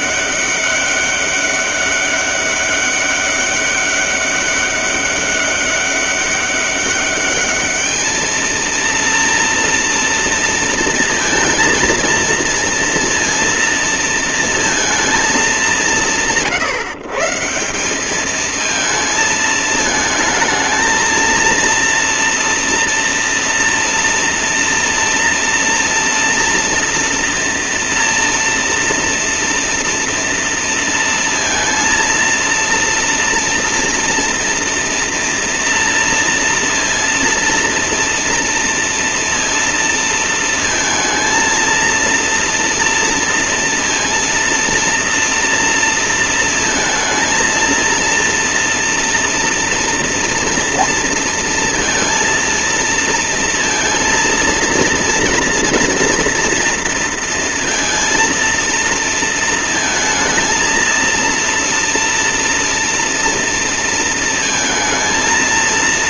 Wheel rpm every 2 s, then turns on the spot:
200, 200, 200, 200, 230, 230, 230, 230, 160, 220, 220, 230, 230, 230, 230, 230, 230, 230, 230, 230, 230, 230, 230, 230, 230, 230, 230, 230, 230, 230, 230, 230, 230.
none